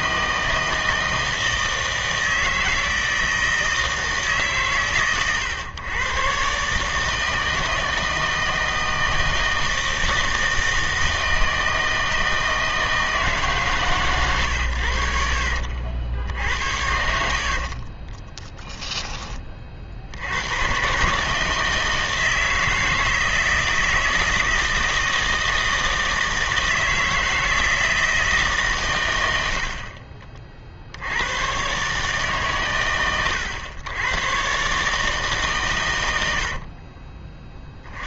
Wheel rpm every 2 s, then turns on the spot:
160, 160, 140, 140, 160, 160, 160, 110, 70, 10, 110, 160, 160, 160, 140, 50, 130, 120, 60.
16-20 36-38